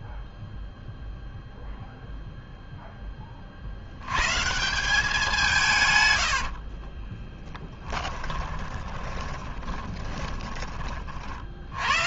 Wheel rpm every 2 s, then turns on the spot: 0, 10, 180, 40, 10, 40.
6-10